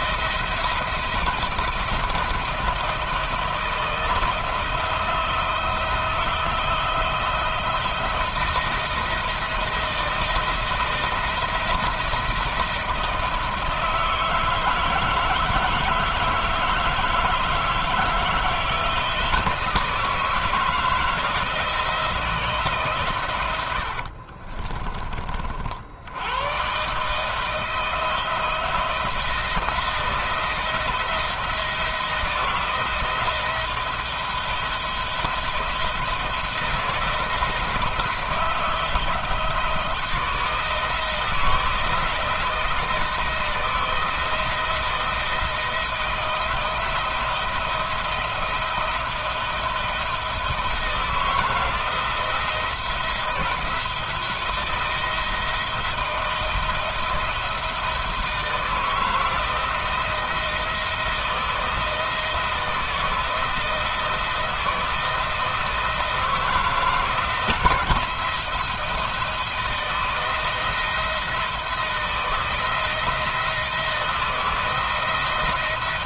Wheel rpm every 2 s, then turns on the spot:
170, 170, 170, 170, 170, 170, 170, 160, 160, 160, 160, 150, 30, 120, 170, 170, 170, 170, 170, 160, 160, 170, 160, 170, 170, 160, 170, 170, 170, 160, 170, 160, 160, 160, 170, 170, 170, 170.
24-26